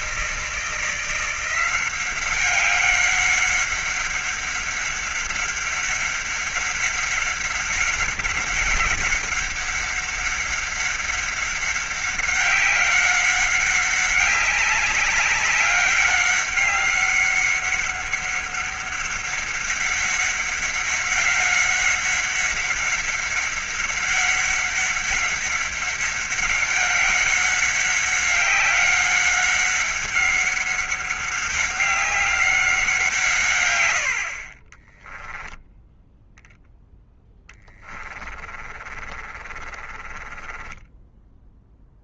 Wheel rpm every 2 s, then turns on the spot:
160, 190, 190, 190, 200, 200, 200, 200, 200, 200, 190, 200, 200, 200, 190, 190, 180, 30, 10, 30, 20.
34-36 38-42